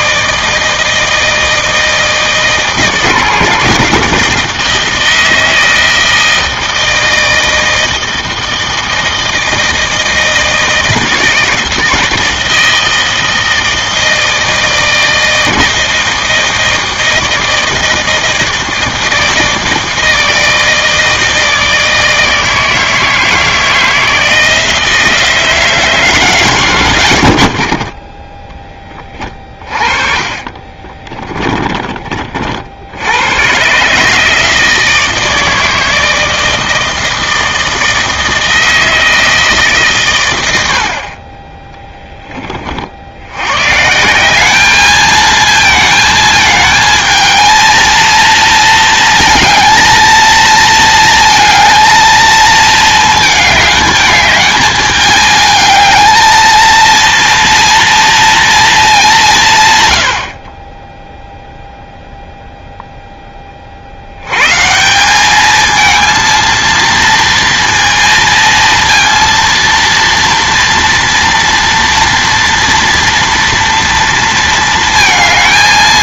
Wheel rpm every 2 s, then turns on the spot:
160, 150, 160, 160, 160, 160, 160, 160, 160, 160, 160, 160, 160, 100, 10, 30, 60, 160, 160, 160, 70, 40, 210, 220, 230, 230, 220, 210, 230, 220, 20, 0, 150, 230, 230, 230, 230, 230.
30-32